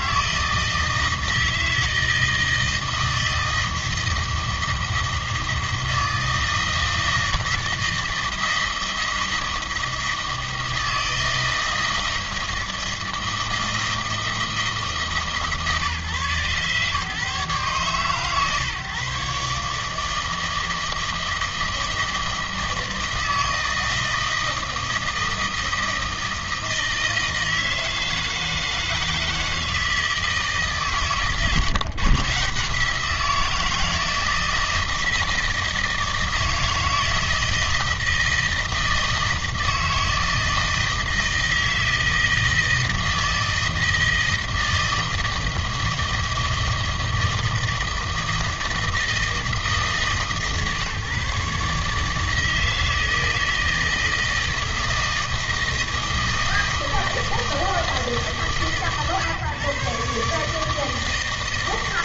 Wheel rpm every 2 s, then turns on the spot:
160, 160, 160, 160, 160, 160, 160, 160, 130, 140, 160, 160, 160, 160, 160, 140, 160, 160, 160, 160, 160, 160, 160, 160, 160, 140, 160, 160, 160, 140, 150.
none